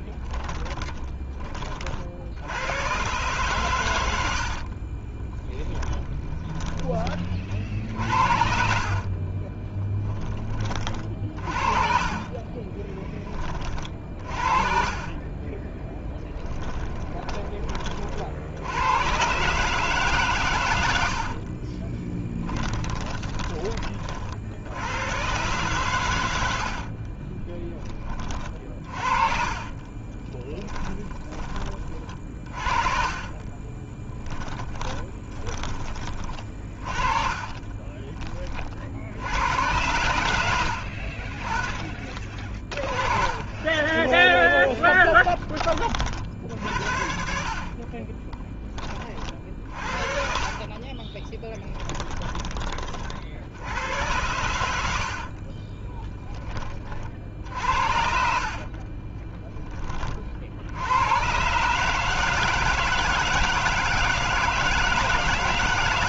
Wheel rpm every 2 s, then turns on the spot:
20, 120, 40, 20, 50, 40, 20, 40, 10, 100, 100, 10, 90, 50, 40, 20, 40, 20, 30, 50, 70, 30, 10, 60, 20, 30, 40, 70, 40, 40, 80, 160, 160.
0-2 4-6 8-10 12-18 22-24 26-38 40-46 50-52 58-60